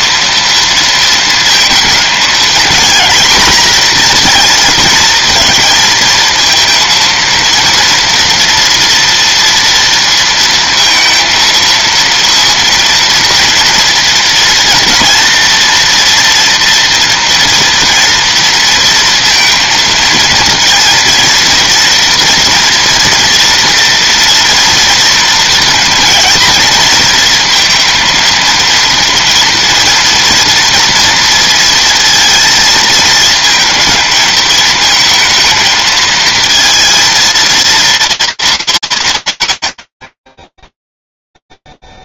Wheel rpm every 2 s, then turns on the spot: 230, 230, 230, 230, 230, 230, 230, 230, 230, 230, 230, 240, 230, 230, 220, 230, 230, 220, 230, 210, 0.
none